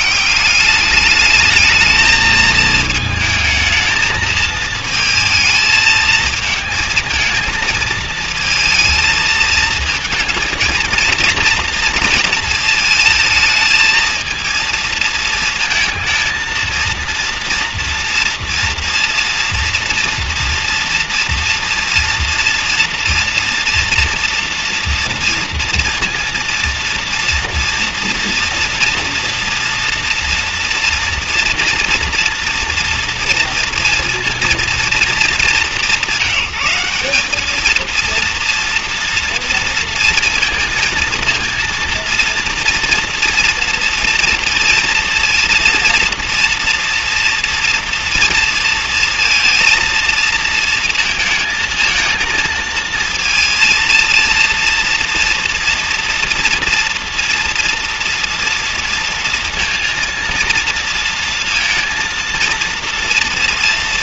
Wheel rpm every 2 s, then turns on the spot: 190, 220, 220, 220, 220, 220, 220, 230, 230, 230, 230, 230, 230, 230, 230, 230, 240, 230, 180, 230, 230, 230, 230, 230, 230, 230, 230, 230, 230, 230, 230, 230.
none